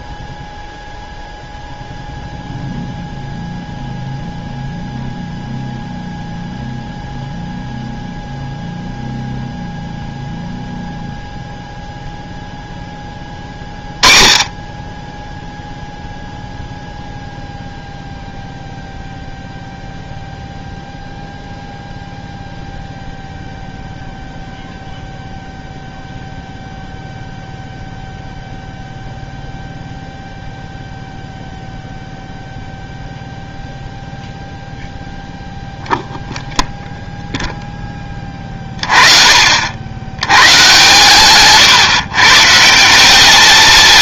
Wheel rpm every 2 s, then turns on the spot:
0, 0, 0, 0, 0, 0, 20, 10, 0, 0, 0, 0, 0, 0, 0, 0, 0, 0, 0, 40, 130, 200.
none